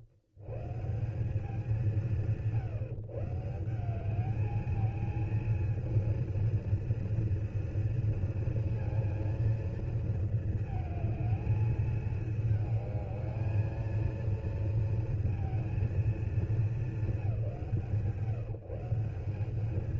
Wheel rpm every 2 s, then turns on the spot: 110, 130, 210, 230, 230, 220, 220, 230, 220, 170.
none